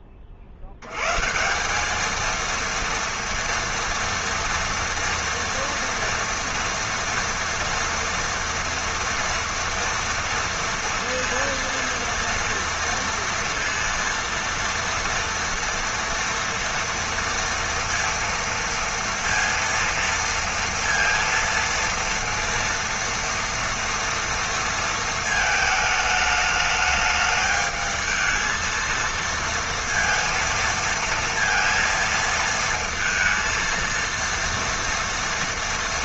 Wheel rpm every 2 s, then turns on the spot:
80, 230, 230, 230, 230, 230, 230, 230, 230, 230, 230, 230, 220, 210, 230, 230, 230, 230.
none